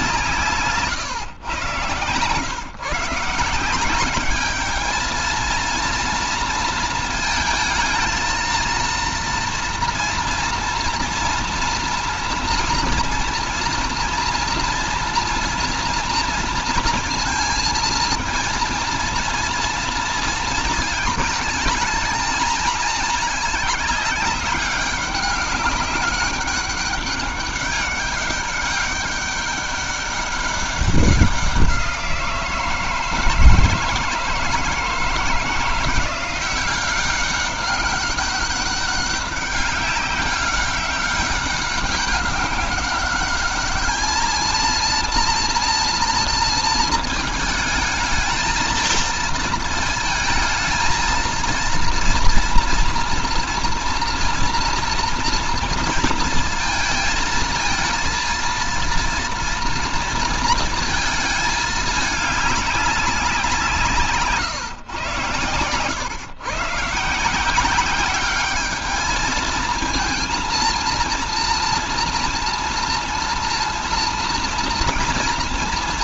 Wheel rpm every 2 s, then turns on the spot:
150, 150, 210, 230, 230, 230, 240, 230, 230, 230, 220, 220, 200, 200, 200, 200, 160, 160, 190, 200, 200, 200, 230, 230, 220, 220, 230, 230, 230, 230, 230, 200, 120, 130, 210, 230, 230, 230.
none